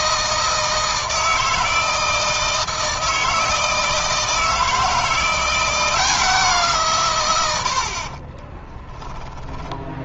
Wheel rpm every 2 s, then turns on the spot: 160, 160, 160, 140, 20.
8-10